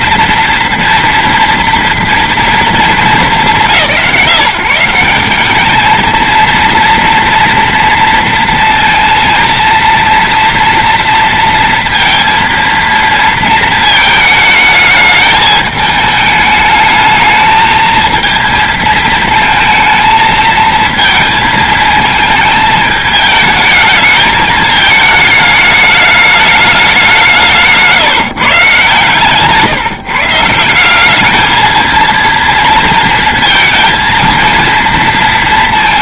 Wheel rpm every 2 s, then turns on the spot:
230, 230, 170, 230, 230, 230, 230, 220, 210, 230, 220, 220, 220, 210, 140, 160, 230, 230.
none